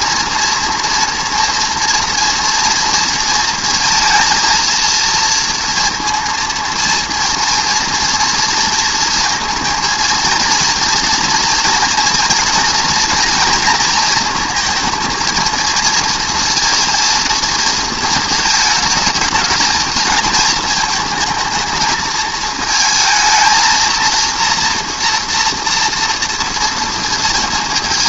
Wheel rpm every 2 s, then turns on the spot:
230, 230, 230, 230, 230, 230, 230, 230, 230, 220, 220, 220, 230, 230.
none